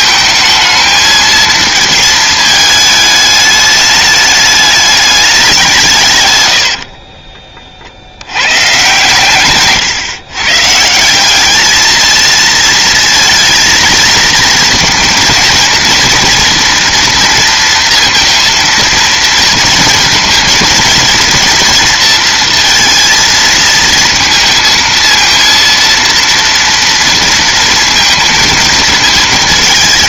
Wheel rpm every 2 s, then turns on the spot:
220, 220, 210, 80, 120, 150, 220, 230, 230, 230, 230, 230, 230, 230, 230.
6-8